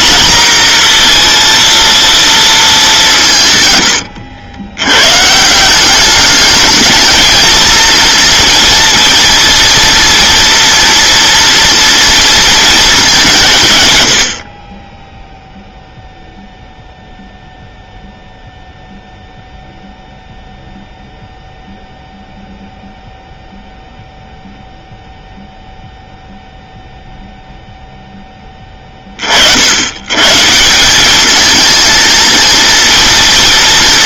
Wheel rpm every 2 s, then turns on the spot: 230, 170, 120, 220, 230, 230, 210, 10, 0, 0, 0, 0, 0, 0, 20, 170, 230.
none